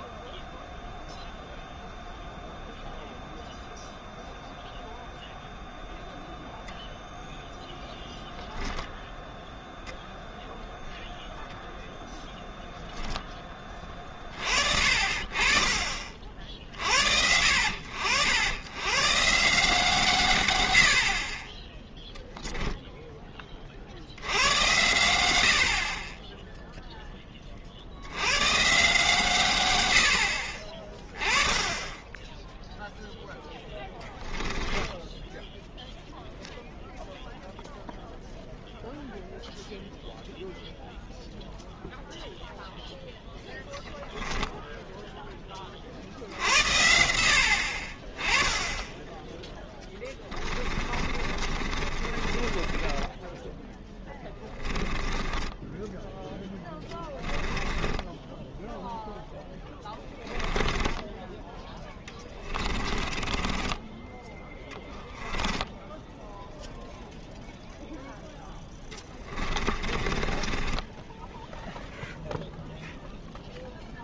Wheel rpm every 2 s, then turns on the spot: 0, 0, 0, 0, 0, 0, 0, 40, 50, 100, 100, 0, 80, 0, 130, 40, 0, 10, 0, 0, 0, 0, 0, 80, 20, 30, 20, 20, 10, 0, 10, 20, 10, 0, 10, 20, 0.
34-36 50-58 60-66 68-72